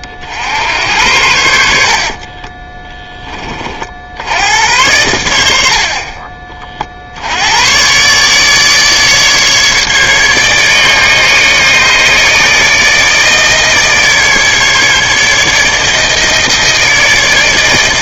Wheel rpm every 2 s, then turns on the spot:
60, 30, 90, 30, 150, 150, 160, 150, 160.
2-4